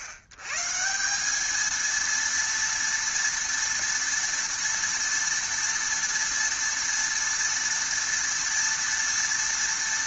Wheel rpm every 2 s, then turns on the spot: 110, 230, 230, 230, 230.
none